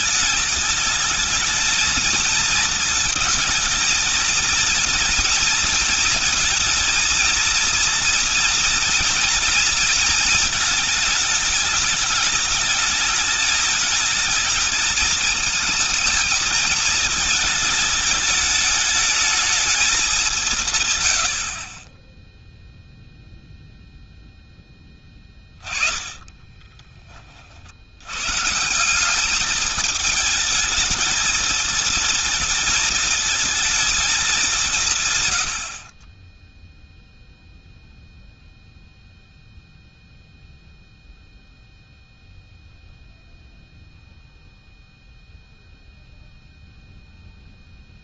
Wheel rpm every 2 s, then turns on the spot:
210, 230, 230, 230, 230, 220, 220, 220, 220, 220, 160, 0, 10, 20, 150, 220, 230, 180, 10, 0, 0, 0, 0, 0.
none